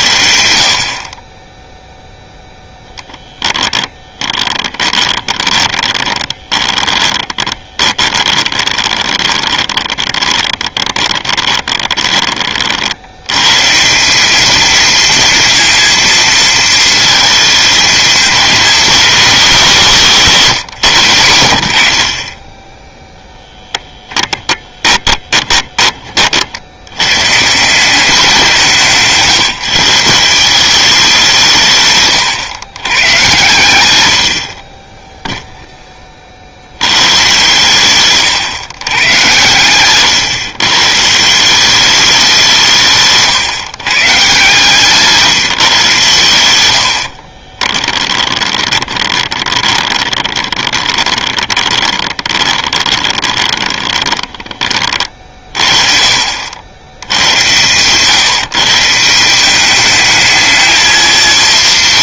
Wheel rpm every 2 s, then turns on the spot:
100, 0, 20, 20, 20, 30, 60, 220, 230, 240, 120, 10, 20, 90, 170, 190, 120, 30, 100, 120, 130, 150, 160, 80, 20, 20, 20, 30, 100, 160, 220.
4-12 24-26 44-54